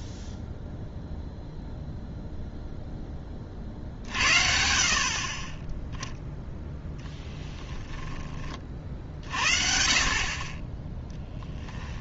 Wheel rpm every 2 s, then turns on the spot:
0, 0, 50, 0, 40, 20.
none